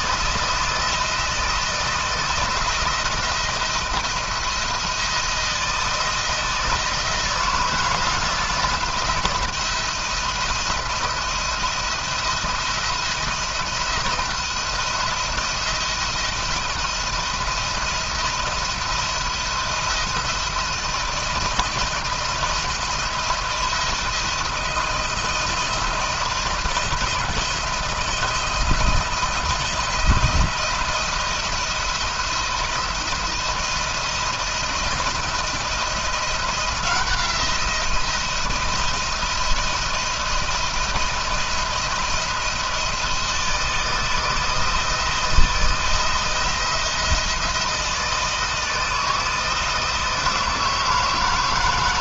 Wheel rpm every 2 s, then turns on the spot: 160, 170, 170, 170, 170, 170, 170, 170, 160, 160, 170, 170, 170, 170, 170, 170, 170, 170, 170, 170, 170, 170, 160, 170, 160, 160.
none